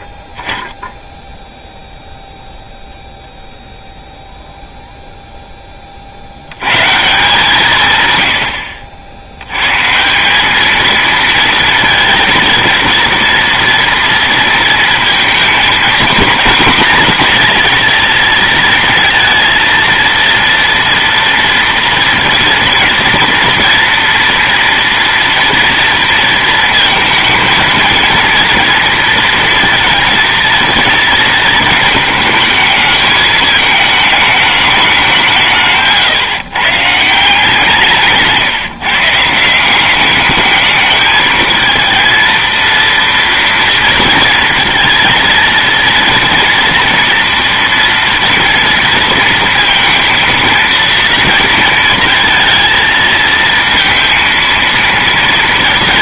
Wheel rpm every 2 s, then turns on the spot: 0, 0, 0, 130, 80, 220, 230, 230, 240, 230, 230, 230, 230, 220, 230, 230, 220, 210, 150, 150, 210, 230, 230, 240, 230, 230, 230, 230.
none